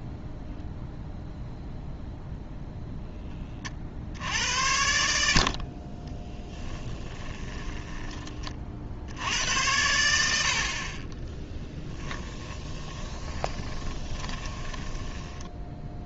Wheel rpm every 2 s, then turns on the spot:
0, 0, 80, 10, 40, 60, 20, 20.
6-8 12-16